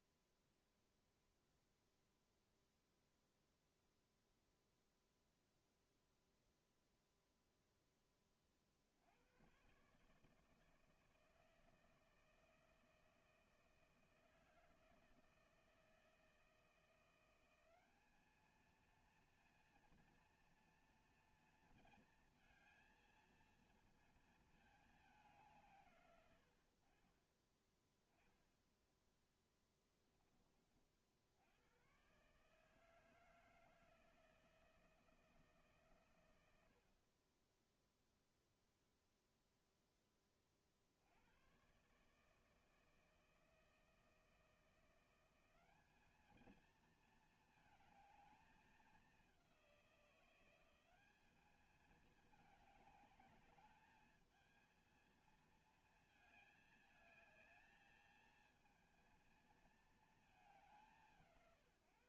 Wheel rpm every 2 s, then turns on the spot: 0, 0, 0, 0, 20, 150, 160, 160, 160, 220, 230, 220, 220, 100, 20, 30, 140, 160, 90, 0, 30, 160, 160, 220, 220, 180, 210, 220, 220, 220, 210.
28-30